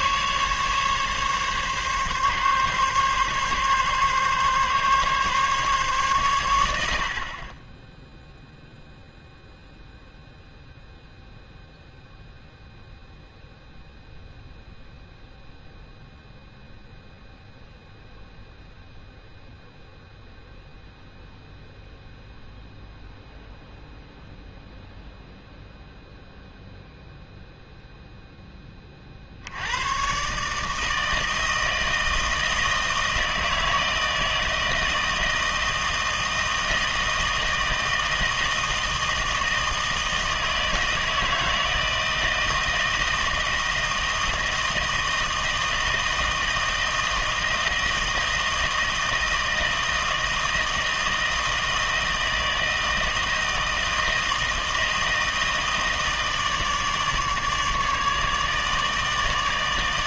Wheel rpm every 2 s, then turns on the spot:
140, 140, 140, 100, 0, 0, 0, 0, 0, 0, 0, 0, 0, 0, 110, 160, 160, 160, 160, 160, 160, 160, 160, 160, 160, 160, 160, 160, 150, 160.
none